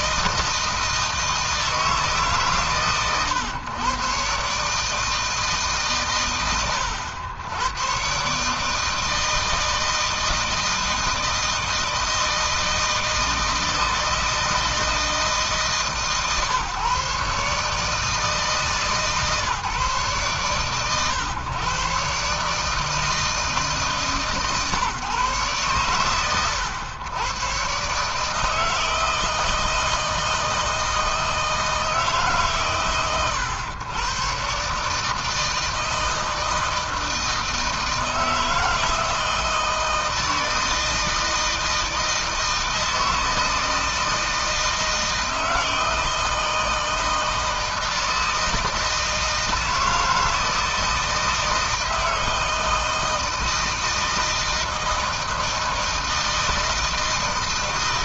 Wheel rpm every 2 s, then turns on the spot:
160, 140, 140, 100, 140, 160, 160, 160, 140, 150, 130, 150, 140, 110, 150, 160, 130, 120, 160, 160, 160, 160, 160, 160, 160, 160, 160, 160, 160.
none